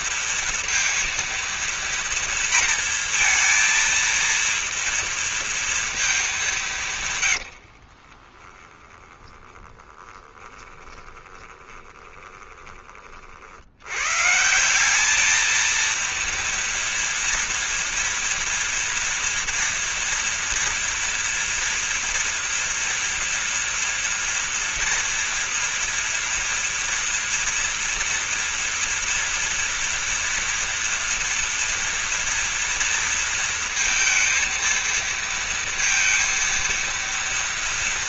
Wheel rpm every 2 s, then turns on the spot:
230, 230, 230, 170, 10, 10, 20, 180, 240, 240, 230, 240, 230, 230, 230, 230, 230, 230, 230.
8-12